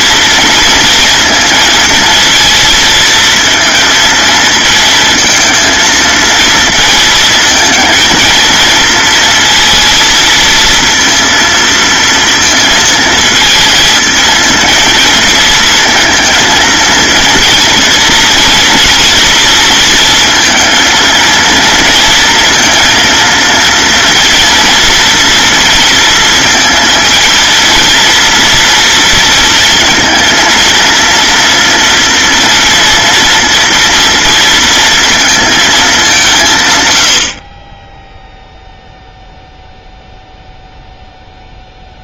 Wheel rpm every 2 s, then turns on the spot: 230, 230, 220, 220, 230, 230, 220, 230, 230, 240, 230, 230, 230, 230, 230, 230, 230, 230, 90, 0, 0.
none